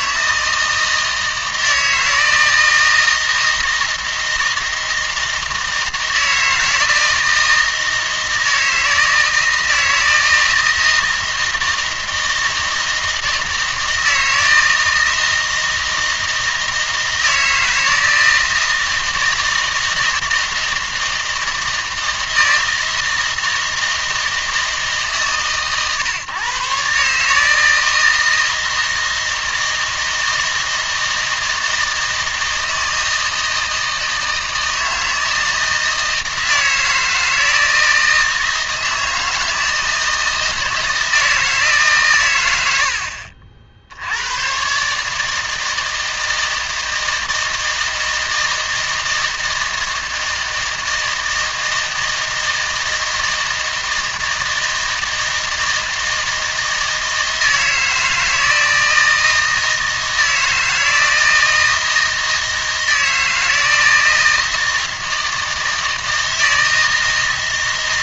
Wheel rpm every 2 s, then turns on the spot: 160, 160, 160, 160, 160, 160, 160, 160, 160, 160, 160, 160, 150, 130, 160, 160, 160, 160, 160, 160, 160, 90, 130, 160, 160, 160, 160, 160, 160, 160, 160, 160, 160, 160.
none